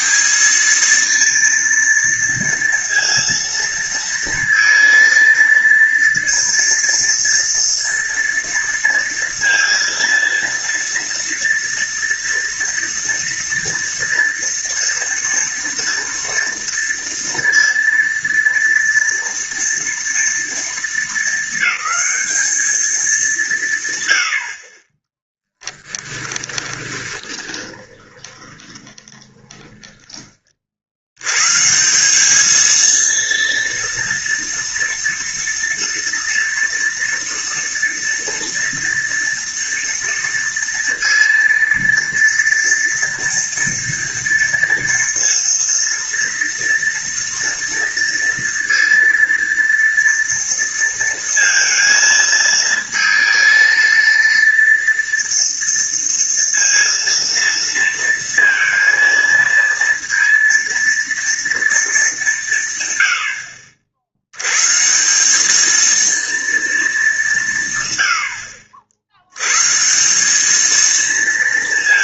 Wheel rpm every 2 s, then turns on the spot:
210, 230, 230, 230, 230, 230, 230, 230, 230, 230, 230, 210, 50, 10, 20, 40, 210, 230, 240, 230, 230, 240, 230, 230, 230, 230, 230, 230, 230, 230, 230, 160, 110, 230, 80, 210.
26-30